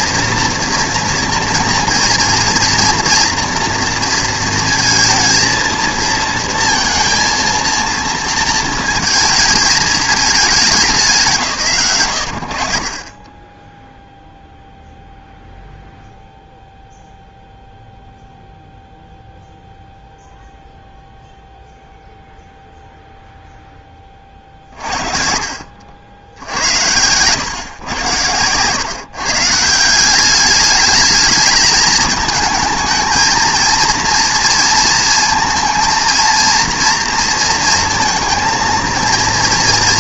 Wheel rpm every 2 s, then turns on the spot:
230, 240, 230, 230, 220, 190, 60, 0, 0, 0, 0, 0, 40, 80, 110, 200, 220, 230, 230, 220.
none